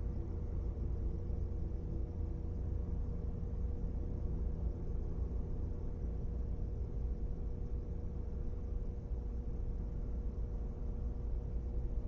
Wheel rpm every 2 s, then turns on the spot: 0, 0, 0, 0, 0, 0.
none